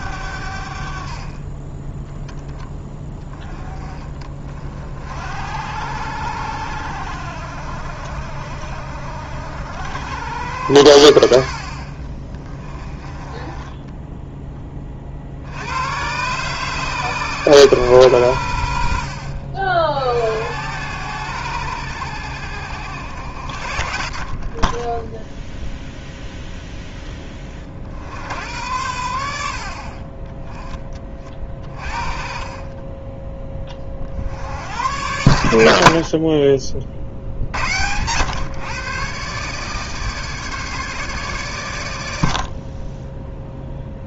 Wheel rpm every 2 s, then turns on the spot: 60, 10, 50, 80, 60, 90, 20, 20, 140, 80, 90, 70, 30, 0, 90, 20, 20, 90, 40, 130, 150, 40.
32-34